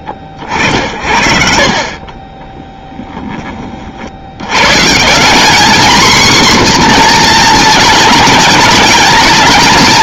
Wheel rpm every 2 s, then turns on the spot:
70, 10, 100, 250, 230.
none